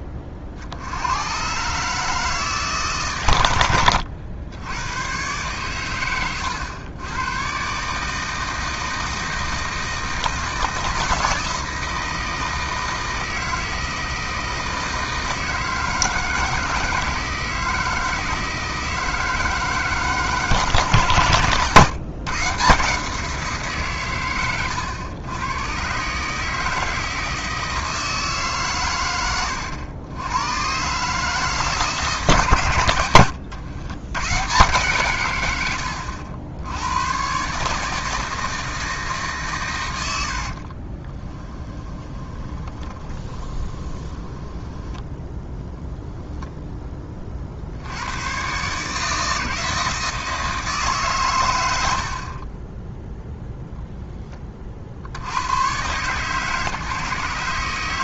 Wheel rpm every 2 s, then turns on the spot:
70, 140, 100, 110, 160, 160, 160, 160, 160, 160, 140, 160, 100, 160, 130, 130, 110, 130, 90, 160, 50, 20, 10, 10, 140, 150, 20, 40, 150.
40-46